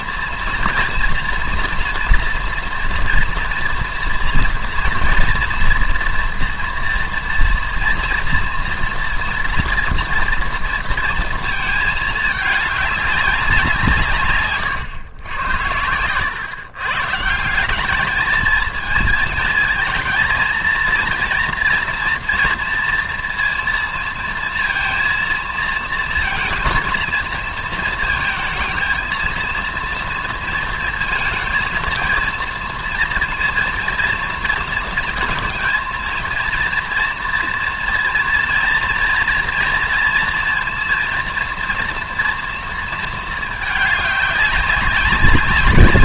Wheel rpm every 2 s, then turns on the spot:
230, 230, 230, 230, 230, 230, 200, 120, 140, 220, 230, 230, 230, 220, 220, 230, 230, 220, 230, 230, 230, 230, 200.
none